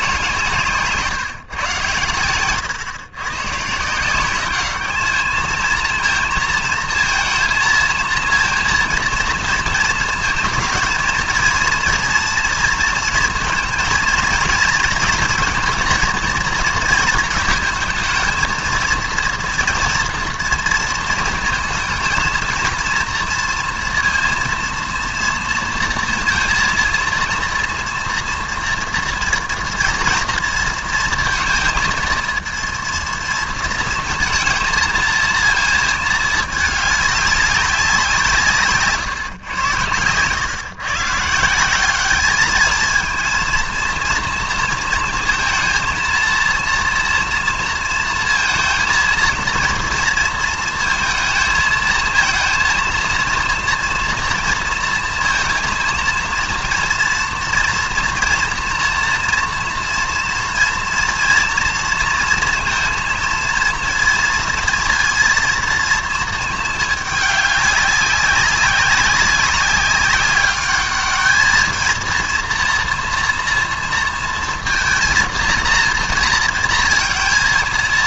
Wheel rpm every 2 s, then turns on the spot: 150, 110, 200, 230, 230, 220, 230, 230, 230, 230, 230, 230, 230, 230, 230, 230, 230, 230, 210, 150, 130, 220, 230, 230, 230, 230, 230, 230, 230, 230, 240, 230, 230, 220, 190, 200, 230, 230, 230.
none